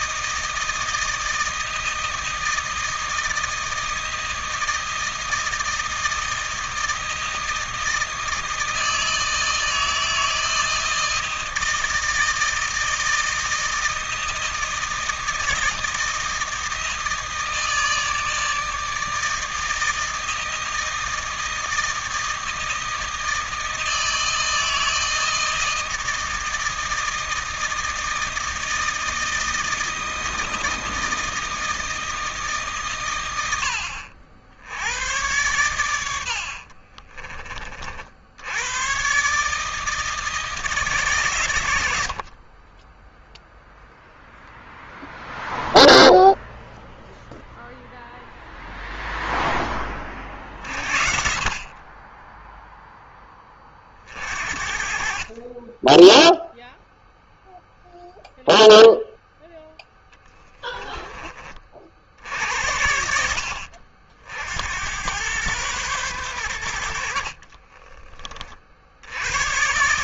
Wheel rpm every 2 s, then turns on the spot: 160, 160, 160, 160, 160, 160, 160, 160, 160, 160, 160, 160, 160, 160, 160, 160, 140, 90, 50, 100, 160, 40, 0, 0, 0, 50, 10, 50, 0, 0, 10, 70, 80, 80, 70.
36-38